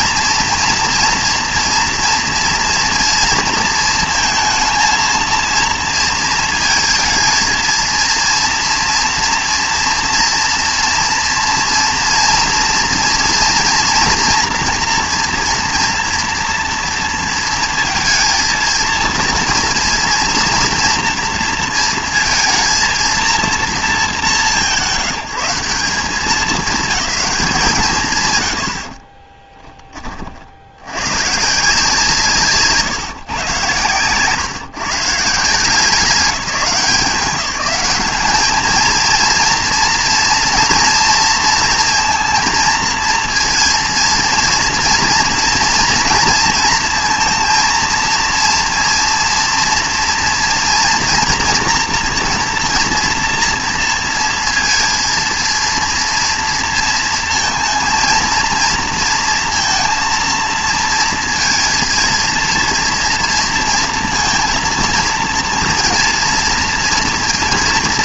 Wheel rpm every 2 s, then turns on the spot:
230, 230, 230, 220, 230, 230, 230, 230, 230, 230, 230, 230, 160, 200, 80, 30, 150, 130, 190, 220, 230, 230, 230, 230, 230, 230, 240, 230, 230, 230, 230, 230, 230, 230.
none